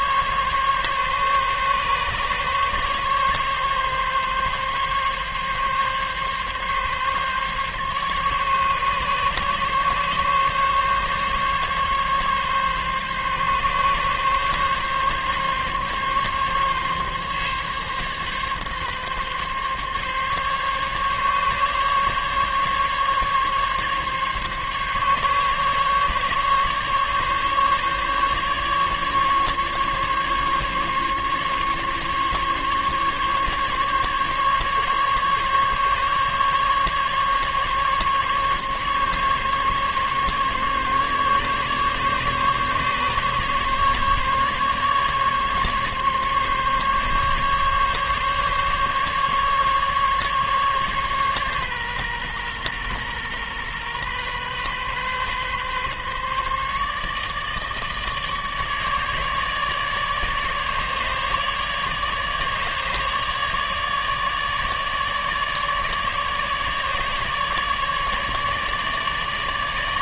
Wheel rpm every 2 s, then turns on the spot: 140, 140, 140, 140, 140, 140, 140, 140, 140, 140, 140, 140, 140, 140, 140, 140, 140, 140, 140, 140, 140, 140, 140, 140, 140, 140, 120, 130, 140, 150, 150, 150, 150, 150, 150.
none